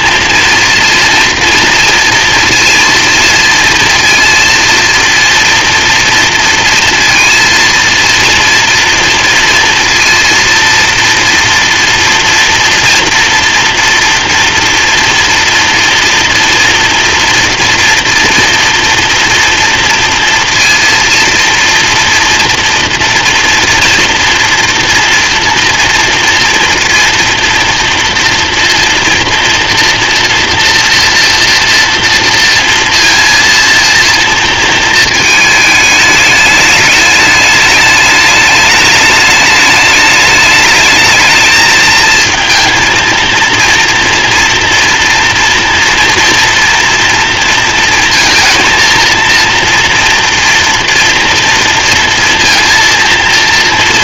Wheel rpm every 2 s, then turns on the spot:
230, 230, 230, 230, 240, 230, 230, 240, 240, 230, 230, 240, 230, 230, 240, 230, 230, 230, 210, 210, 210, 220, 230, 230, 230, 230, 230.
none